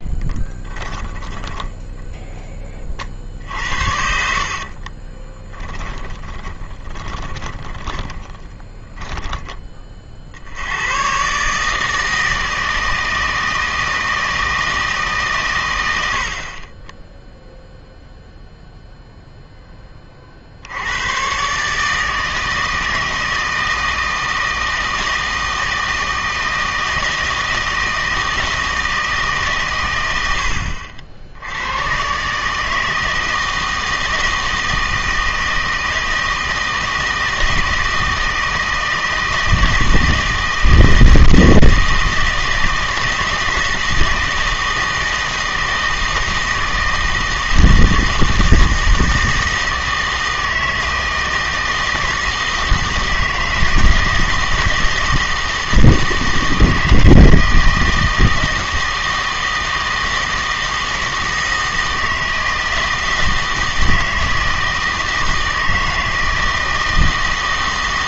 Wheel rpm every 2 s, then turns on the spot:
10, 30, 40, 20, 30, 90, 160, 160, 30, 0, 80, 160, 160, 160, 160, 70, 160, 160, 160, 160, 160, 160, 160, 160, 160, 160, 160, 160, 160, 160, 160, 160, 160, 160.
0-2 4-10